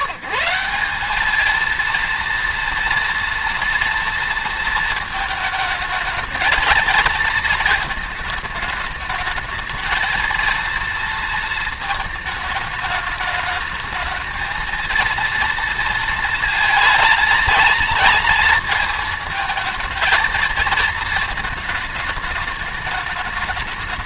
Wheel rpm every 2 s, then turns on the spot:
180, 230, 230, 220, 210, 230, 220, 230, 230, 230, 220, 210.
none